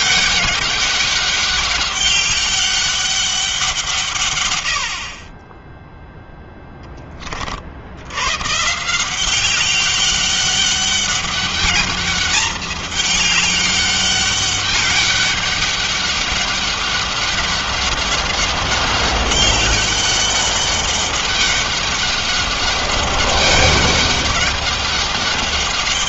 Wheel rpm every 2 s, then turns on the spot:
200, 200, 130, 10, 120, 200, 210, 200, 200, 200, 200, 200, 200.
none